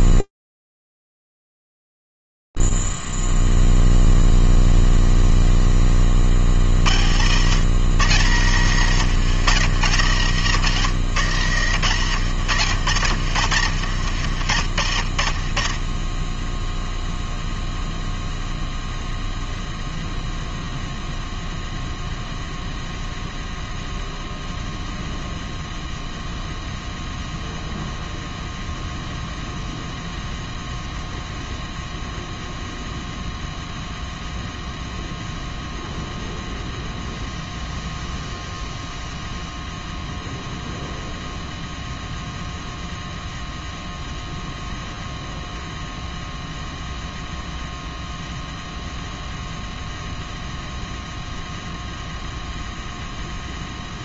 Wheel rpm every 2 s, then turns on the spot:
0, 0, 0, 40, 140, 150, 130, 80, 10, 0, 0, 0, 0, 0, 0, 0, 0, 0, 0, 0, 0, 0, 0, 0, 0, 0, 0.
none